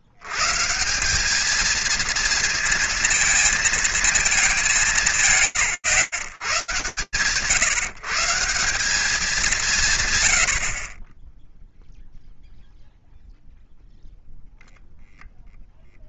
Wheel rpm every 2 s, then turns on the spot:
150, 230, 210, 110, 160, 120, 0, 0.
none